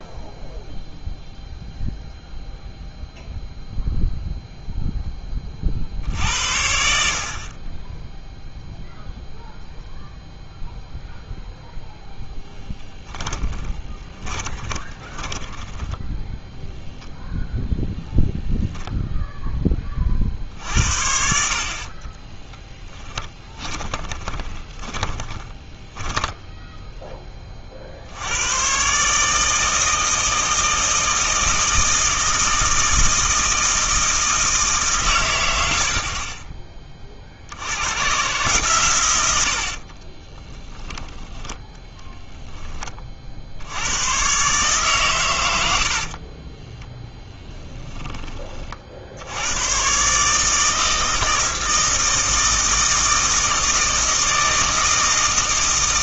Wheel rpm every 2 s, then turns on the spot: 0, 0, 0, 70, 0, 0, 10, 20, 0, 0, 60, 10, 20, 10, 120, 160, 160, 150, 20, 130, 10, 20, 130, 20, 40, 160, 160, 160.
12-16 22-26 46-48